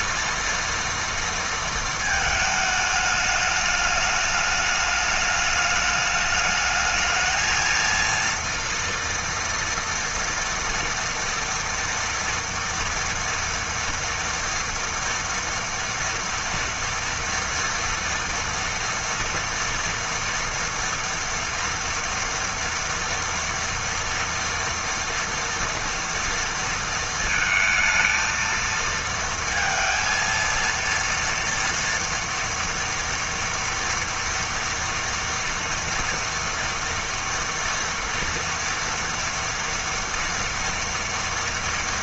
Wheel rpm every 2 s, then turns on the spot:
230, 220, 210, 210, 230, 230, 230, 230, 230, 230, 230, 230, 230, 230, 230, 230, 230, 240, 230, 230, 230.
none